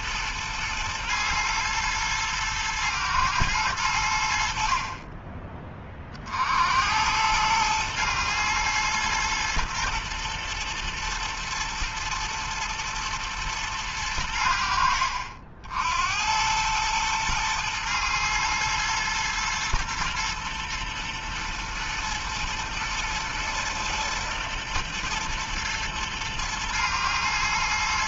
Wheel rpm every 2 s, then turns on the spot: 120, 110, 30, 90, 120, 110, 110, 60, 110, 110, 120, 120, 110, 110.
none